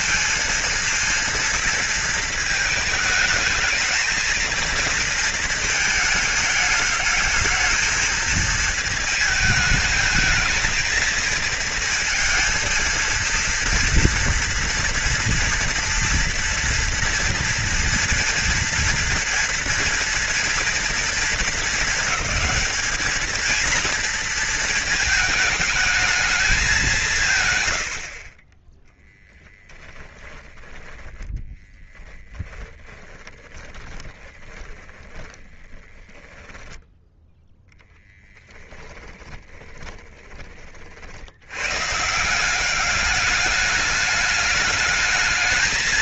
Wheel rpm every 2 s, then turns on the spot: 230, 220, 230, 220, 220, 220, 230, 240, 230, 240, 230, 210, 220, 220, 40, 10, 10, 20, 10, 10, 30, 180, 210.
30-36 38-40